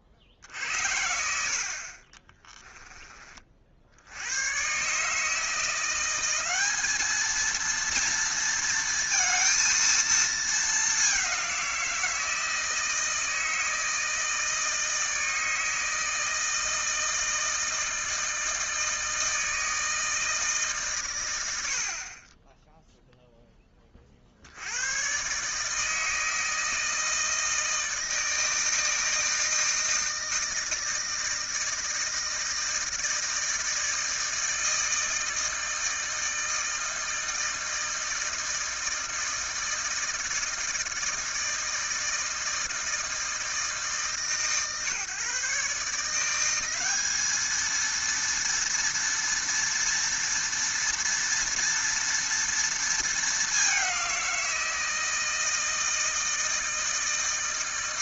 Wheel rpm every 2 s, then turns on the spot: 40, 10, 120, 200, 230, 210, 160, 160, 160, 160, 140, 10, 90, 160, 160, 160, 160, 160, 160, 160, 160, 160, 130, 190, 230, 230, 230, 170, 160.
2-4